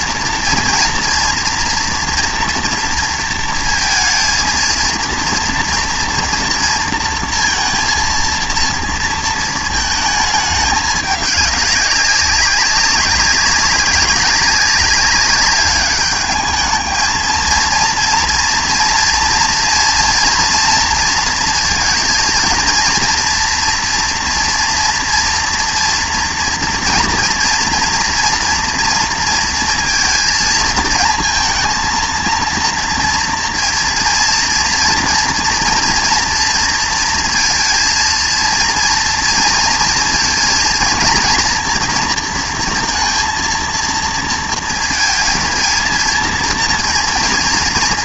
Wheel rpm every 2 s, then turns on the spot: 230, 230, 230, 230, 230, 210, 190, 200, 220, 230, 230, 230, 230, 230, 230, 220, 230, 230, 230, 230, 230, 230, 230, 230.
none